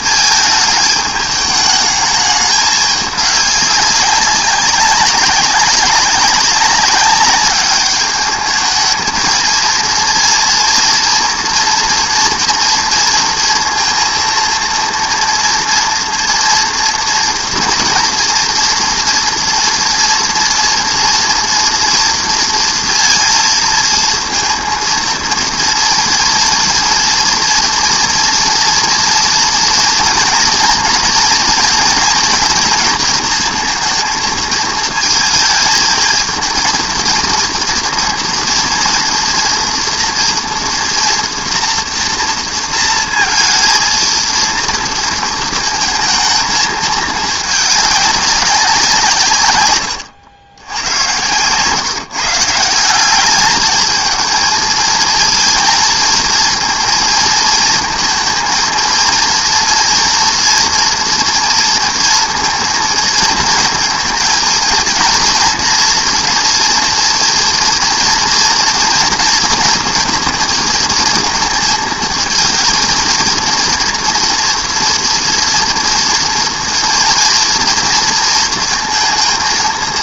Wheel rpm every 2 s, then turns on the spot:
220, 210, 190, 190, 210, 230, 230, 230, 240, 240, 230, 230, 230, 230, 230, 230, 230, 220, 220, 230, 230, 230, 230, 220, 200, 90, 160, 220, 230, 230, 230, 230, 220, 230, 230, 230, 220, 230, 230, 230.
none